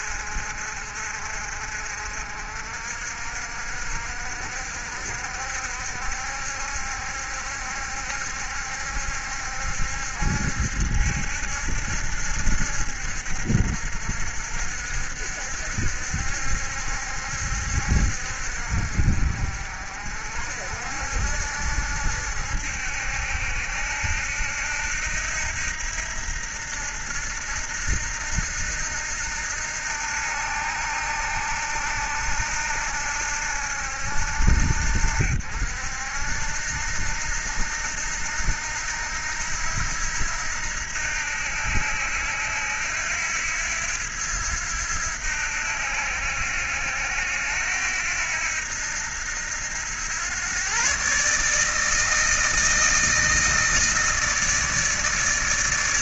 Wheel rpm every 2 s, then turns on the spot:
50, 60, 60, 70, 70, 70, 70, 60, 70, 60, 70, 70, 80, 80, 80, 80, 80, 70, 80, 80, 80, 80, 80, 80, 80, 130, 160, 160.
none